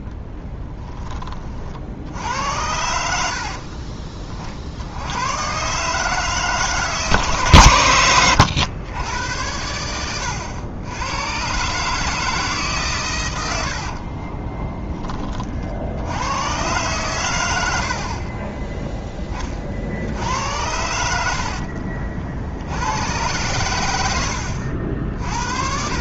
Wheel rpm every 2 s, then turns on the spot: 10, 80, 60, 150, 100, 100, 140, 10, 120, 20, 90, 80, 70.
0-2